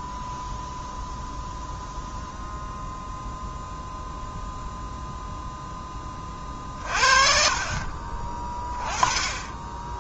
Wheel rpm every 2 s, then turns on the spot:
0, 0, 0, 40, 20.
6-8